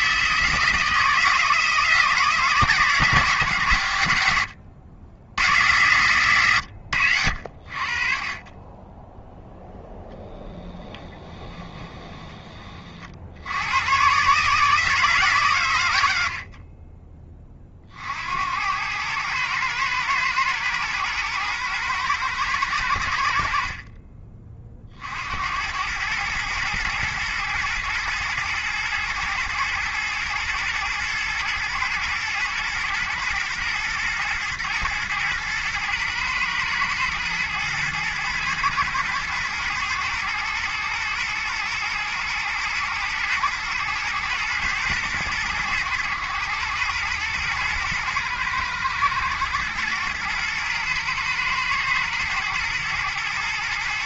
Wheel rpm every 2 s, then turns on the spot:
160, 150, 80, 100, 10, 10, 40, 150, 20, 100, 110, 90, 50, 120, 120, 120, 120, 110, 120, 110, 110, 110, 120, 110, 110, 110, 120.
10-12